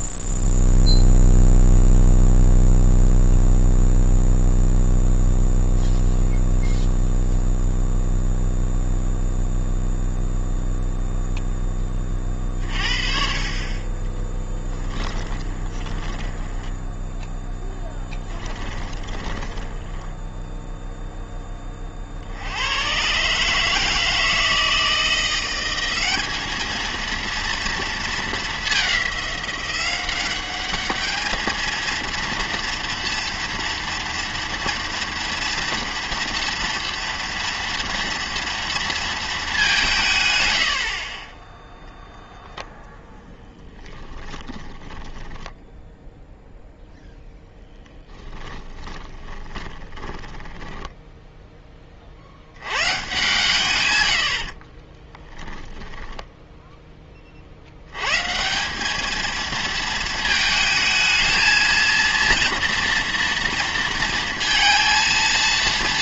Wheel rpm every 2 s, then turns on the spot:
0, 0, 0, 0, 0, 0, 40, 10, 10, 10, 0, 100, 160, 220, 200, 200, 230, 230, 240, 230, 90, 0, 10, 0, 10, 10, 100, 30, 10, 190, 220, 230, 230.
14-20 44-46 48-52 54-56